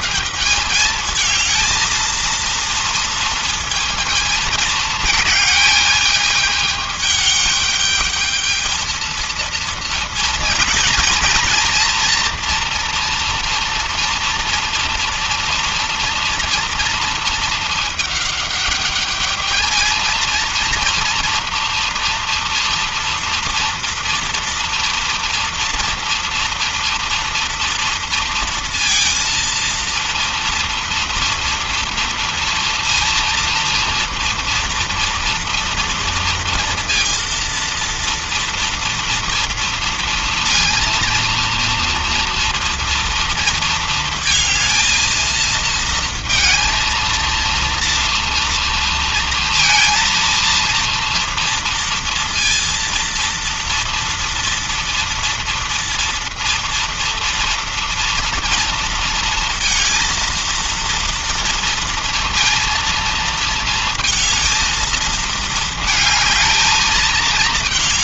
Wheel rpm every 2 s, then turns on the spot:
190, 230, 220, 210, 220, 230, 240, 230, 230, 210, 230, 230, 230, 230, 230, 230, 230, 230, 230, 230, 230, 230, 220, 230, 230, 230, 230, 230, 230, 230, 230, 230, 220, 220.
none